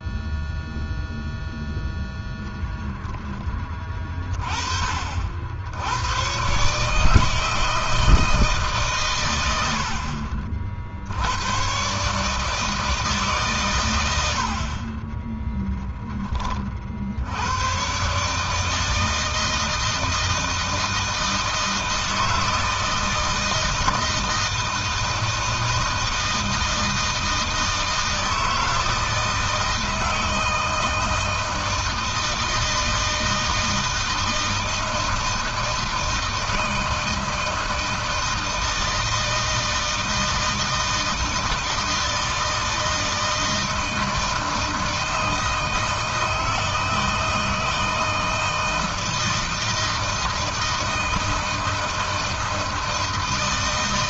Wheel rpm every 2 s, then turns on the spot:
0, 0, 30, 130, 150, 60, 160, 50, 30, 150, 160, 160, 160, 160, 160, 160, 160, 160, 160, 160, 160, 160, 160, 160, 160, 160, 160.
none